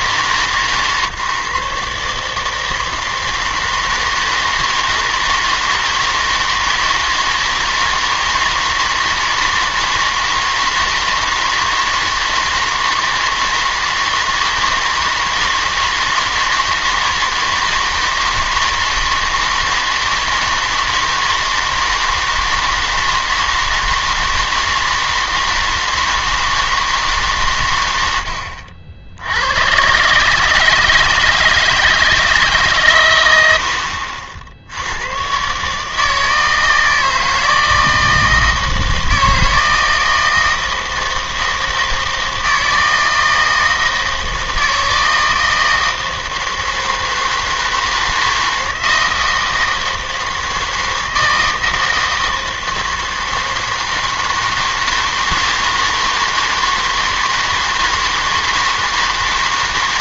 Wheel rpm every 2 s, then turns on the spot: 140, 160, 160, 160, 160, 160, 160, 160, 160, 160, 160, 160, 160, 160, 70, 160, 140, 70, 160, 160, 160, 160, 160, 160, 160, 160, 160, 160, 160, 160.
none